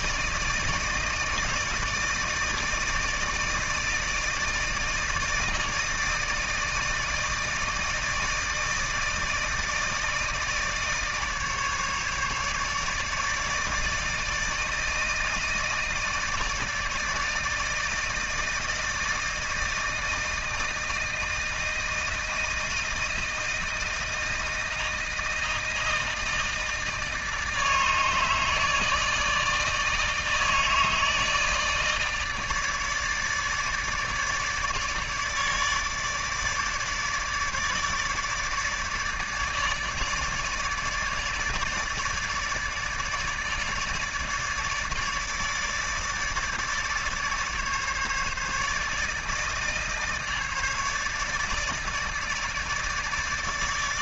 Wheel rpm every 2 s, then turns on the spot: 160, 160, 160, 160, 160, 160, 150, 160, 160, 160, 160, 160, 160, 160, 160, 160, 150, 150, 150, 150, 150, 150, 150, 150, 150, 150, 150.
none